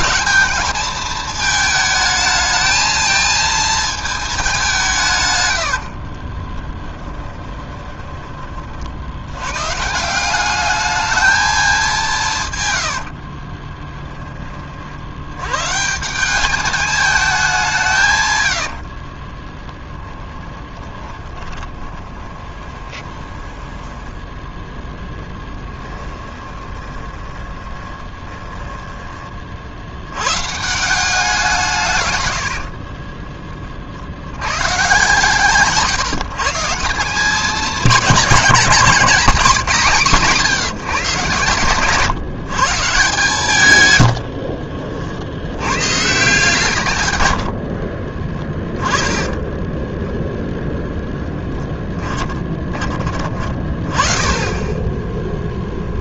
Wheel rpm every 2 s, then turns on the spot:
200, 220, 180, 20, 30, 200, 120, 40, 200, 70, 20, 20, 10, 20, 10, 150, 70, 120, 160, 200, 170, 140, 50, 150, 20, 0, 20, 20.
6-8 12-14 18-24 26-30 32-34 44-46 48-50